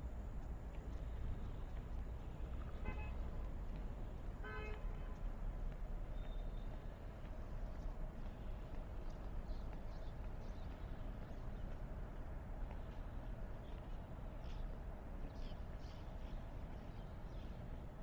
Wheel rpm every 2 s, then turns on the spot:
0, 0, 0, 0, 0, 0, 0, 0, 0.
none